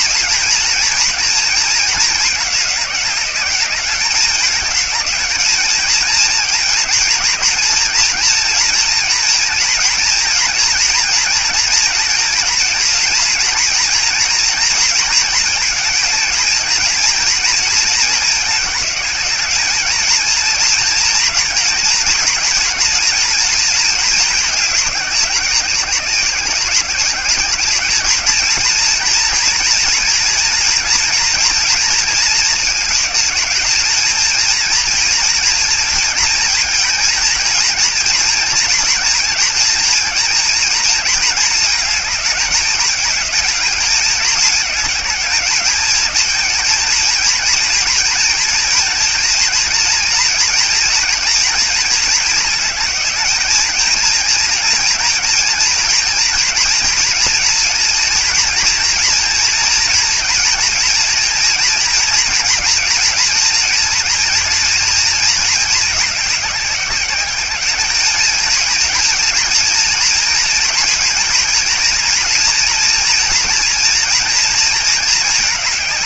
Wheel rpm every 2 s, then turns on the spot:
230, 200, 210, 230, 230, 230, 230, 230, 220, 210, 230, 230, 210, 190, 220, 230, 210, 230, 220, 230, 230, 210, 210, 230, 230, 230, 220, 230, 230, 230, 230, 230, 230, 200, 220, 230, 230, 230.
none